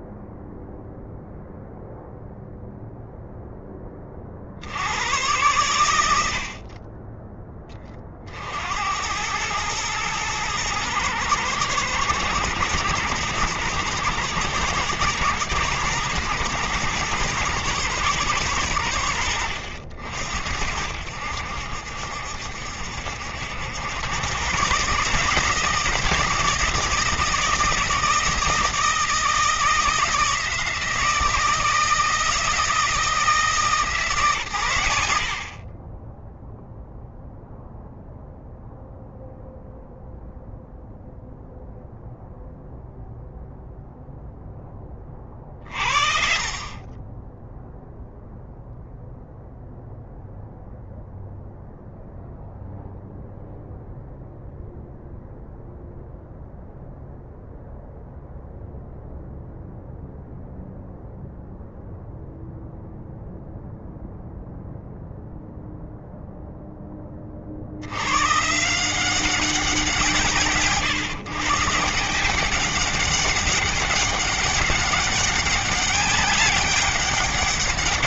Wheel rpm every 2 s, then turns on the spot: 0, 0, 50, 80, 50, 110, 110, 110, 120, 110, 60, 70, 120, 160, 160, 160, 160, 130, 10, 0, 0, 0, 10, 50, 0, 0, 0, 0, 0, 0, 0, 0, 0, 0, 150, 160, 190, 200, 200.
none